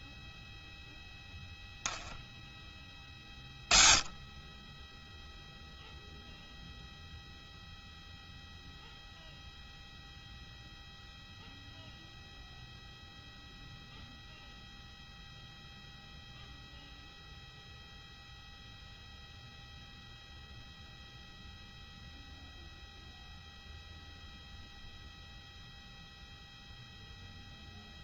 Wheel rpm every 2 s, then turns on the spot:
0, 0, 10, 0, 0, 0, 0, 0, 0, 0, 0, 0, 0, 0.
none